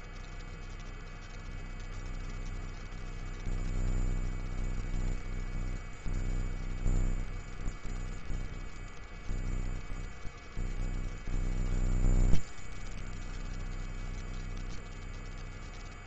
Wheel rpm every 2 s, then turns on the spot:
0, 0, 0, 0, 0, 0, 0, 0.
none